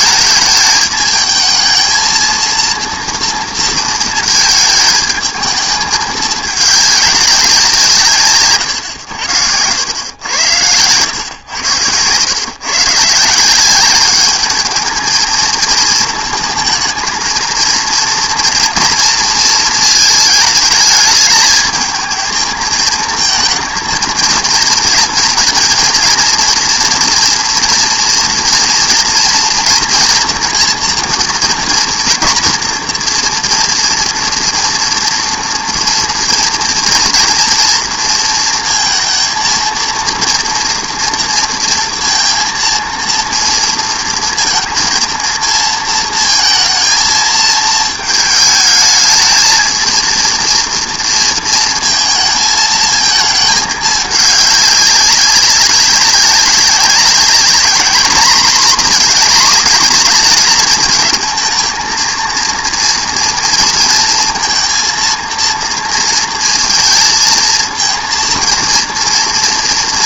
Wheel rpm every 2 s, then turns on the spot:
220, 230, 220, 210, 120, 100, 130, 210, 220, 230, 220, 220, 230, 230, 230, 230, 230, 230, 230, 230, 240, 230, 230, 230, 220, 230, 220, 200, 200, 230, 230, 240, 230, 230, 230.
none